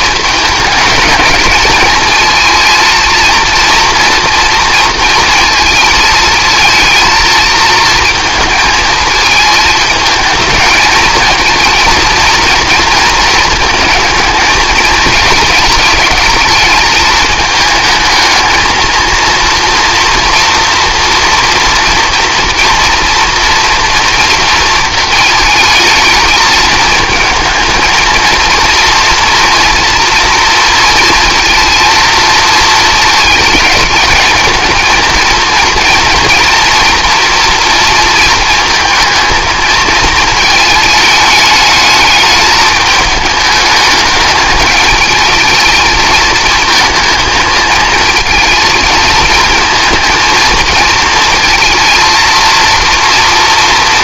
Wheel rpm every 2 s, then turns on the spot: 210, 220, 230, 230, 220, 220, 230, 220, 220, 220, 240, 230, 230, 220, 230, 230, 220, 230, 230, 220, 220, 210, 210, 230, 230, 220, 230.
none